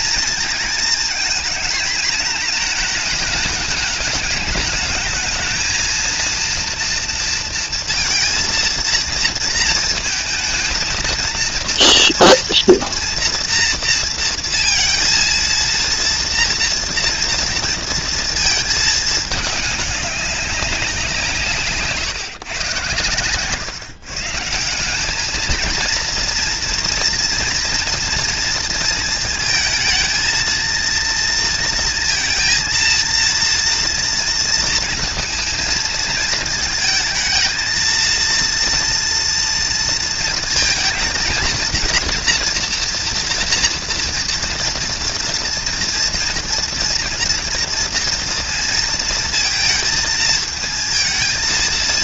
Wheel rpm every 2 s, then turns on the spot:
220, 220, 220, 240, 230, 230, 230, 230, 230, 220, 180, 120, 180, 230, 220, 230, 230, 230, 220, 230, 230, 230, 230, 230, 230, 220.
none